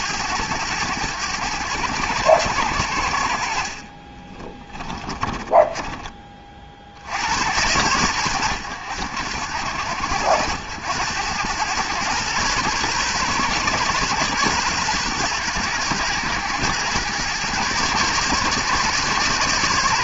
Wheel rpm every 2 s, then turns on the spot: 100, 90, 30, 40, 90, 90, 130, 120, 110, 130.
4-6